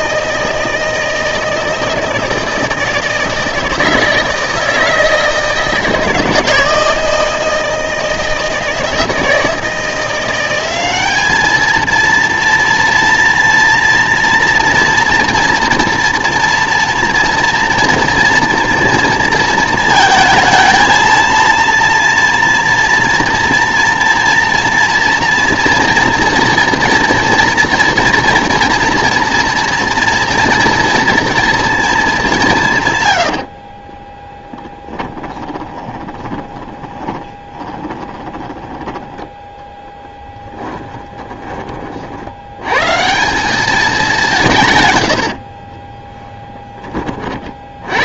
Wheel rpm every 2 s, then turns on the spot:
160, 160, 160, 160, 160, 190, 240, 230, 230, 230, 230, 230, 230, 240, 230, 230, 140, 10, 20, 10, 30, 110, 150, 10.
34-38 40-42